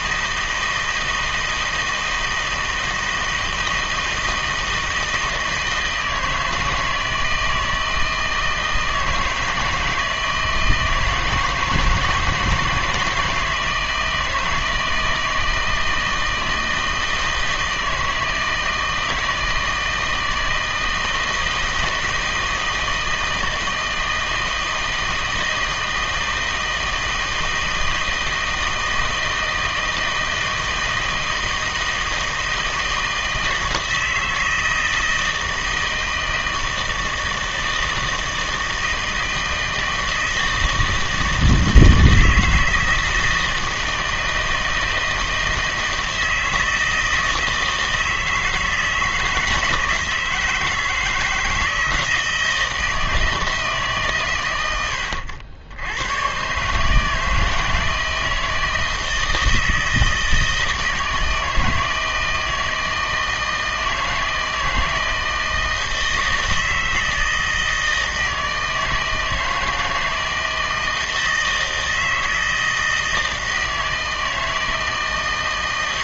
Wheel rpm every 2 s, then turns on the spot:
160, 160, 160, 160, 160, 160, 160, 160, 160, 160, 160, 160, 160, 160, 160, 160, 160, 160, 160, 160, 160, 160, 160, 160, 160, 160, 160, 90, 140, 160, 160, 160, 160, 160, 160, 160, 160, 160.
none